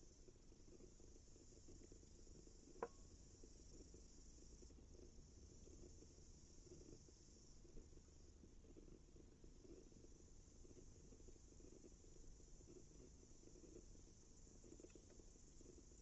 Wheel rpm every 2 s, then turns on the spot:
0, 0, 0, 0, 0, 0, 0, 0.
none